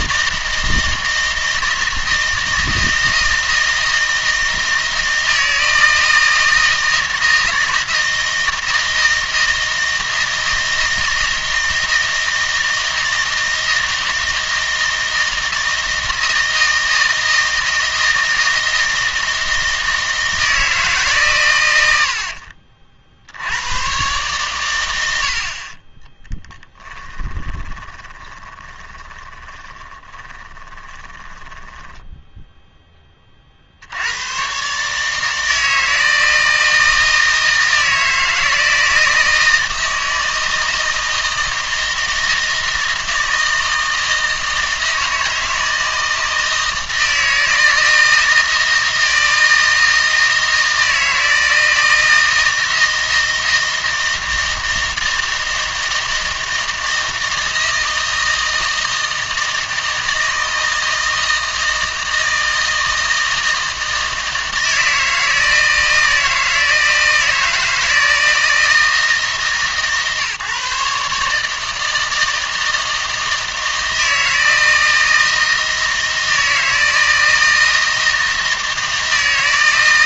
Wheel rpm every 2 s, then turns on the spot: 160, 160, 160, 160, 160, 160, 160, 160, 160, 160, 160, 60, 110, 10, 20, 20, 10, 150, 160, 160, 160, 160, 160, 160, 160, 160, 160, 160, 160, 160, 160, 160, 160, 160, 160, 150, 160, 160, 160, 160.
22-24 26-32